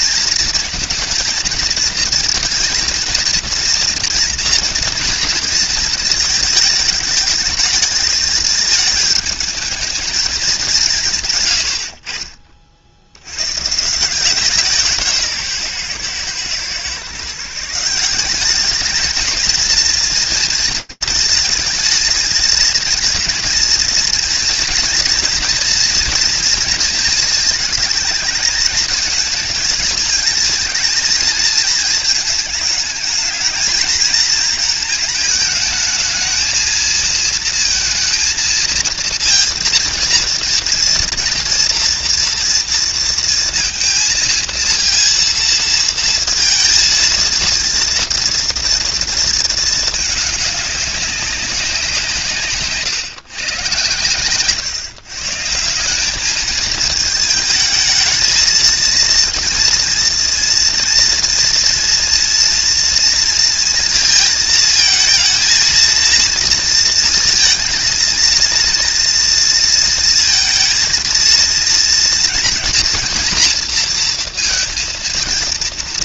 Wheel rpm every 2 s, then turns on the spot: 230, 230, 230, 220, 220, 190, 30, 170, 120, 200, 230, 230, 230, 230, 210, 220, 220, 220, 230, 230, 230, 230, 230, 230, 230, 210, 160, 130, 210, 220, 230, 230, 220, 230, 230, 230, 230, 230.
52-54